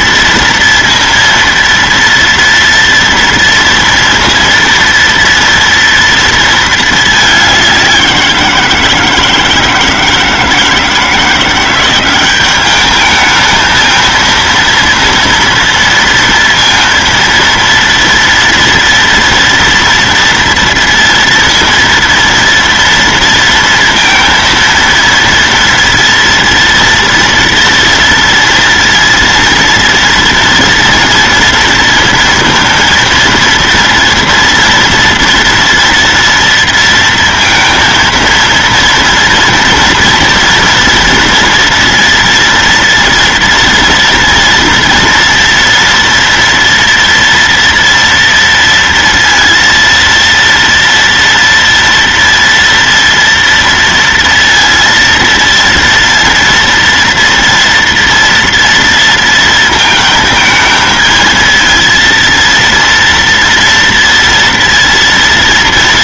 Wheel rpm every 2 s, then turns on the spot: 230, 230, 230, 220, 170, 160, 210, 230, 230, 230, 230, 230, 230, 230, 230, 230, 230, 230, 230, 230, 230, 230, 240, 230, 230, 230, 230, 230, 230, 230, 220, 230, 230.
none